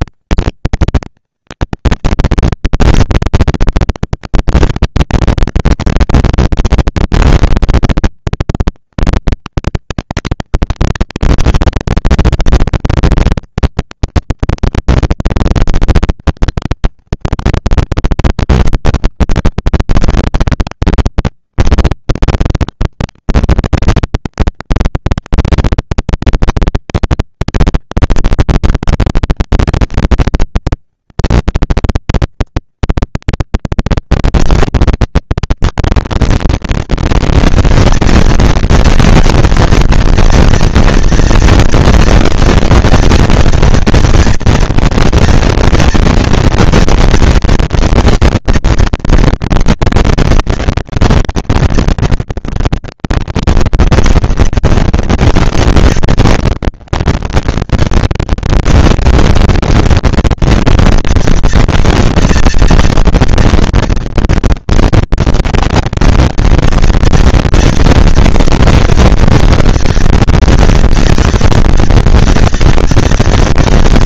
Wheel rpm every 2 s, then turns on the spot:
220, 230, 230, 230, 230, 230, 230, 240, 230, 200, 200, 210, 230, 220, 230, 230, 230, 230, 230, 230, 230, 240, 230, 230, 230, 230, 210, 190, 200, 230, 240, 230, 230, 230, 230, 230, 230.
none